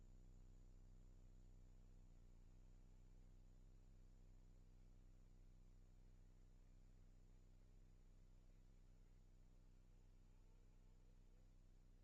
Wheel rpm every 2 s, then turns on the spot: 20, 30, 50, 50, 50, 50.
none